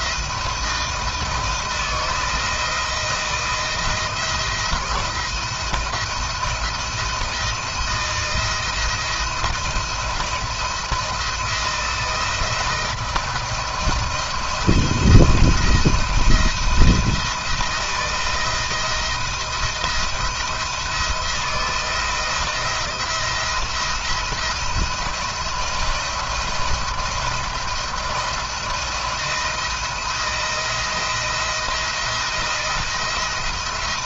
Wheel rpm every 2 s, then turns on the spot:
160, 170, 160, 160, 170, 170, 160, 170, 170, 170, 170, 170, 170, 170, 170, 170, 170.
none